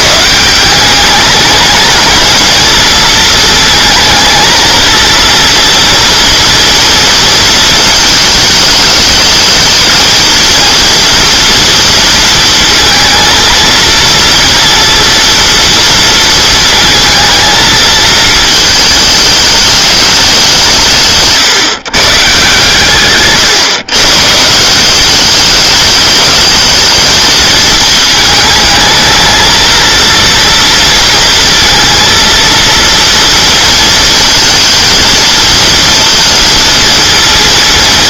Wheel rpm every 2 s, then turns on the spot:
180, 220, 230, 230, 220, 230, 230, 230, 220, 220, 180, 150, 170, 220, 220, 230, 230, 230, 230.
none